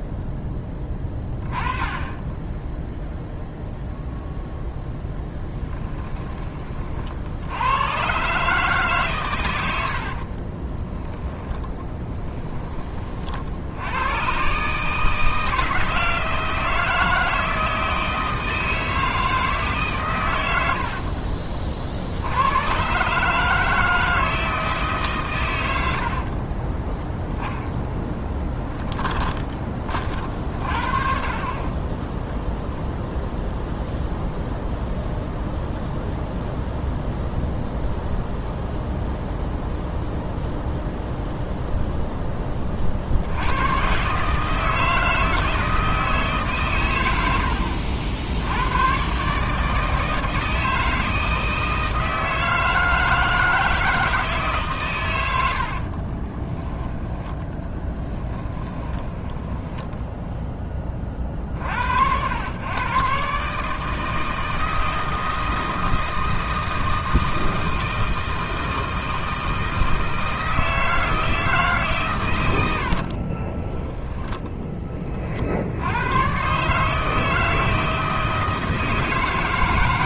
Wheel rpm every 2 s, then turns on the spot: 20, 0, 0, 40, 140, 10, 30, 150, 160, 160, 80, 120, 150, 10, 10, 40, 0, 0, 0, 0, 0, 40, 160, 120, 120, 160, 160, 120, 10, 10, 30, 120, 160, 160, 160, 160, 80, 20, 150, 160.
10-12 26-30 56-60 72-74